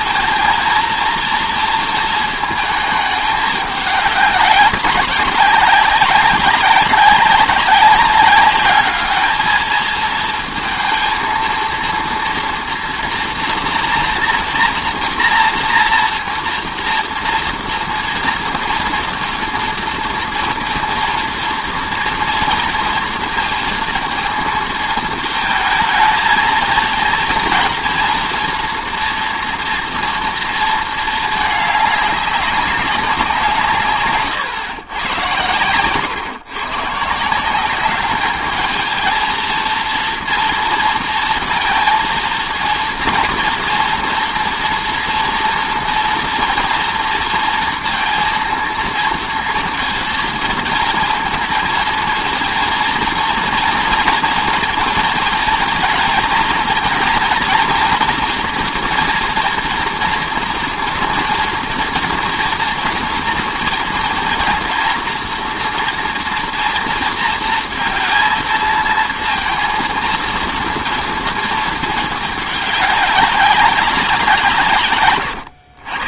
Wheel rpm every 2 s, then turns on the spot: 230, 220, 190, 200, 200, 230, 240, 230, 230, 240, 230, 230, 230, 230, 230, 230, 200, 130, 120, 220, 230, 230, 230, 230, 230, 220, 230, 230, 230, 240, 230, 230, 240, 230, 230, 230, 210, 160.
none